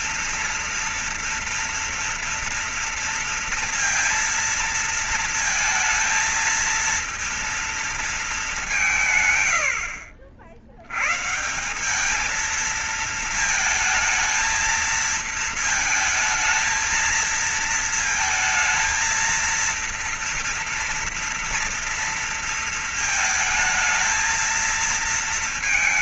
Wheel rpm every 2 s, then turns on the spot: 230, 230, 230, 230, 220, 80, 200, 220, 220, 220, 230, 230, 220.
none